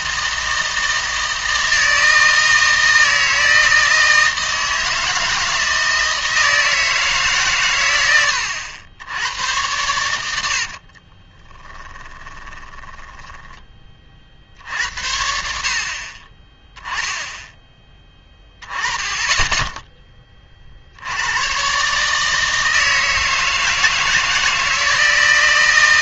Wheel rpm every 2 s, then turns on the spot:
160, 160, 160, 160, 80, 70, 20, 70, 10, 20, 40, 160, 160.
10-14